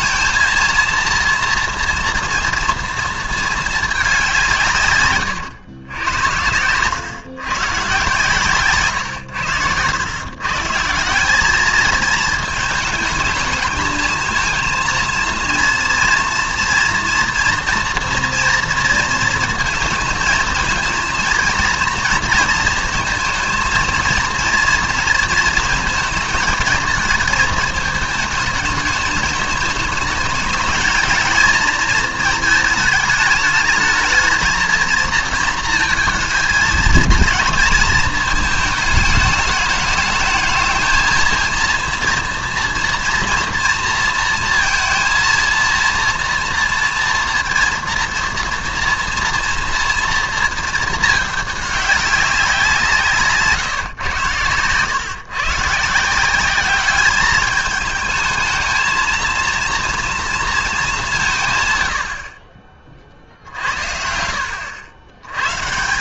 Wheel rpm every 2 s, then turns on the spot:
230, 230, 150, 110, 140, 150, 220, 220, 230, 230, 230, 230, 230, 220, 220, 220, 220, 230, 220, 220, 220, 230, 230, 240, 230, 220, 180, 110, 200, 220, 220, 40, 90.
none